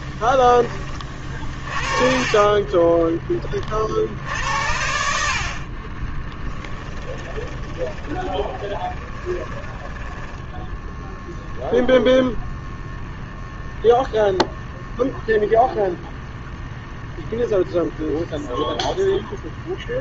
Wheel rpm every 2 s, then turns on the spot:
30, 20, 70, 10, 20, 0, 0, 0, 0, 0.
2-4 8-10